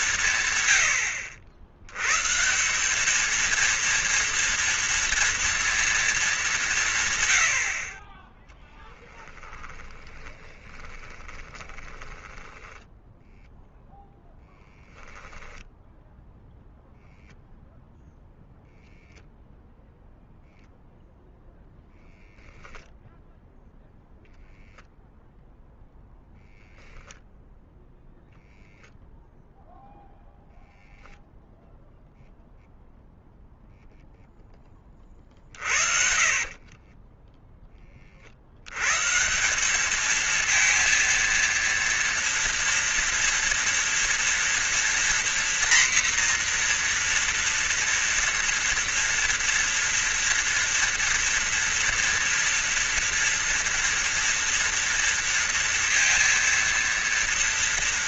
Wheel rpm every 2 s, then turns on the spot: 80, 230, 230, 30, 10, 20, 10, 0, 0, 0, 0, 10, 10, 0, 0, 0, 0, 30, 20, 140, 230, 230, 240, 240, 230, 230, 230, 230, 230.
8-14 36-38